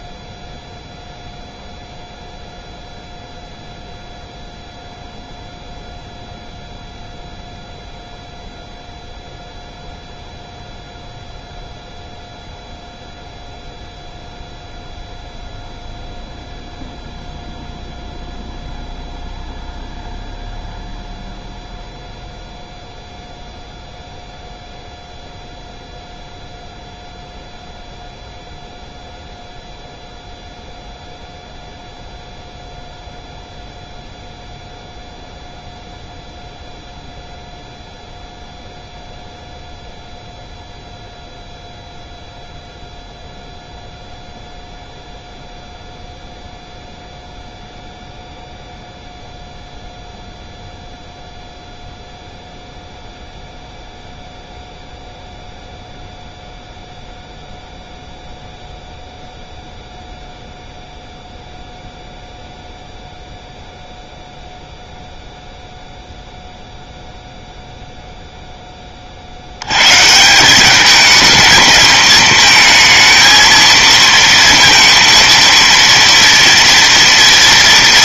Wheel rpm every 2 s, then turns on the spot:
0, 0, 0, 0, 0, 0, 0, 0, 0, 0, 0, 0, 0, 0, 0, 0, 0, 0, 0, 0, 0, 0, 0, 0, 0, 0, 0, 0, 0, 0, 0, 0, 0, 0, 20, 200, 220, 230, 230.
none